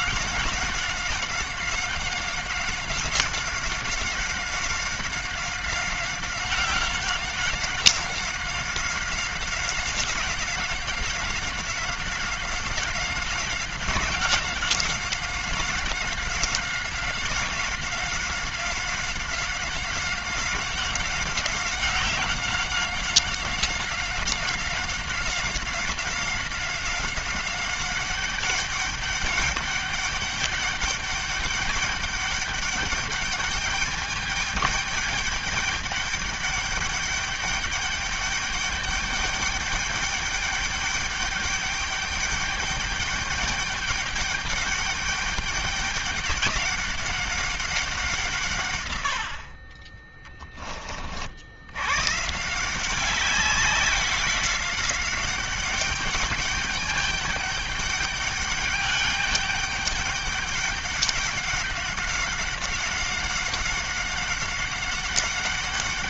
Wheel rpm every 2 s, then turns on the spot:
190, 190, 190, 190, 190, 180, 190, 190, 190, 190, 190, 190, 190, 190, 200, 200, 200, 210, 210, 200, 210, 200, 200, 200, 130, 20, 160, 190, 200, 210, 200, 200, 190.
none